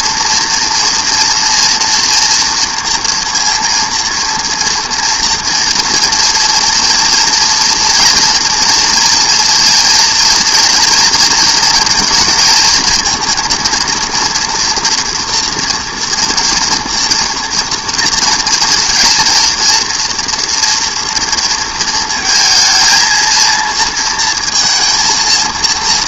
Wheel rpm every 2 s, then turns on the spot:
230, 230, 230, 230, 230, 230, 220, 230, 230, 230, 230, 230, 230.
none